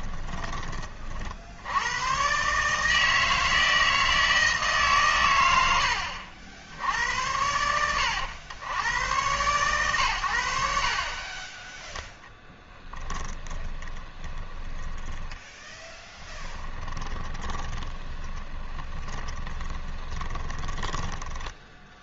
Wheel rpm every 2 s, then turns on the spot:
30, 150, 140, 80, 110, 60, 10, 10, 10, 20, 10.
12-22